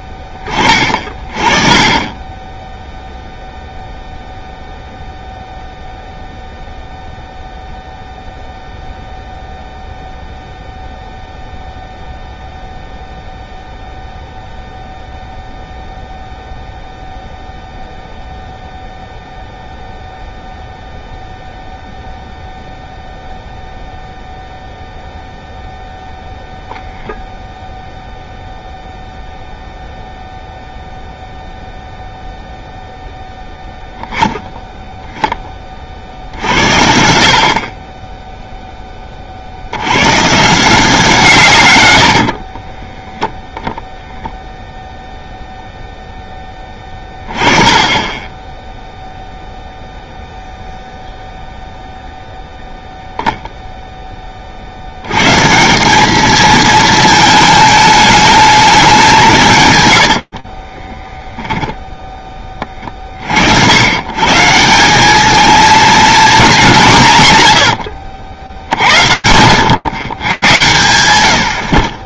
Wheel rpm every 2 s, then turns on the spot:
20, 10, 0, 0, 0, 0, 0, 0, 0, 0, 0, 0, 0, 0, 0, 0, 0, 0, 70, 0, 160, 50, 0, 20, 10, 0, 0, 50, 220, 210, 60, 20, 180, 200, 70, 110.
42-44 60-62